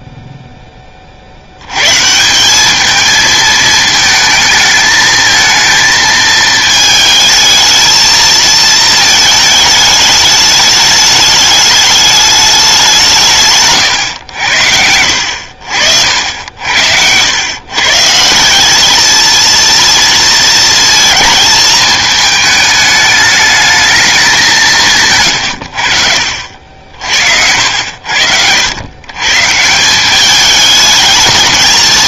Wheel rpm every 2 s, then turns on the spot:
0, 180, 220, 220, 220, 210, 200, 80, 70, 180, 230, 220, 180, 60, 90, 210.
16-18